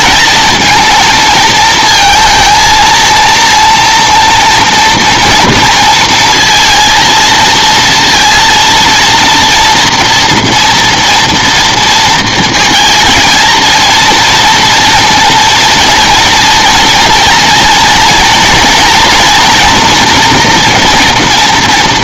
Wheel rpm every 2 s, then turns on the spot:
230, 230, 240, 230, 230, 230, 220, 230, 230, 230, 230.
none